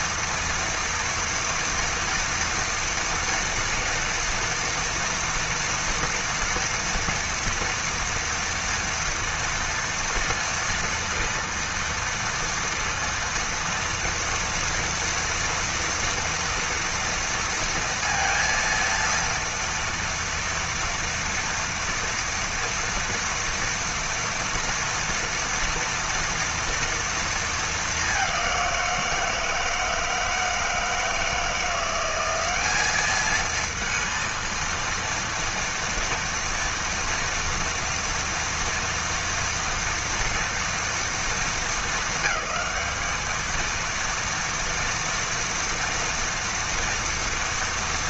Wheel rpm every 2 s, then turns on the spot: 230, 230, 230, 240, 230, 230, 230, 230, 230, 230, 230, 230, 230, 230, 190, 160, 190, 230, 230, 230, 230, 220, 230, 230.
none